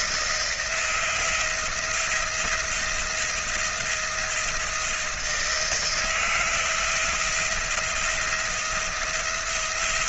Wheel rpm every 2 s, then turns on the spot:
170, 170, 170, 170, 170.
none